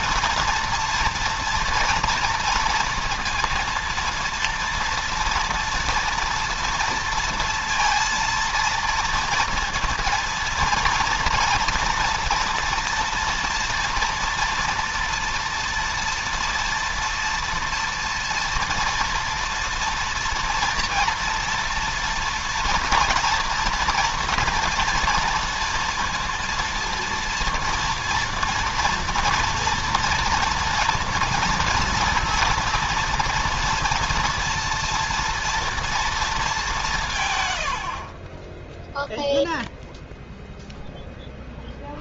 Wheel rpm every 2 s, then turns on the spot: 230, 230, 230, 230, 230, 230, 240, 230, 230, 230, 230, 230, 230, 230, 230, 230, 230, 230, 200, 10, 0.
none